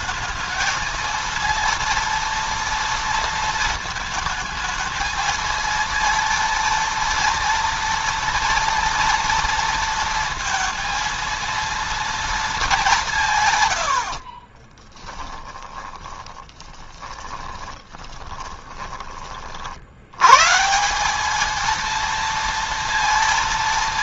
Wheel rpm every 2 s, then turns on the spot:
220, 230, 220, 230, 230, 230, 210, 40, 30, 20, 140, 230.
14-20